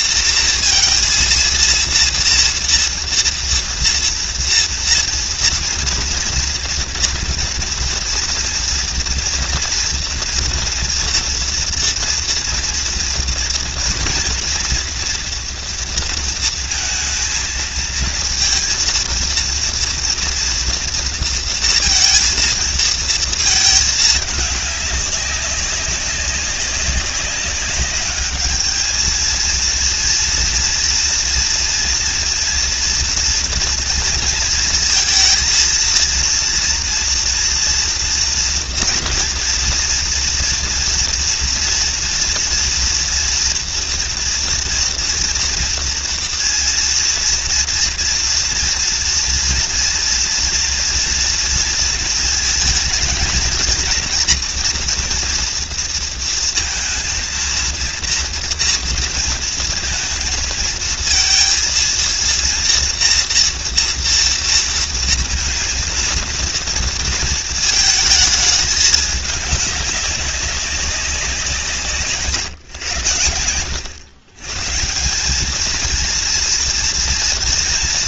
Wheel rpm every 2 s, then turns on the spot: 230, 230, 230, 240, 240, 240, 230, 240, 230, 230, 230, 230, 210, 190, 210, 240, 230, 230, 230, 240, 230, 230, 230, 230, 230, 230, 220, 230, 230, 230, 220, 230, 230, 230, 220, 200, 130, 140, 230.
none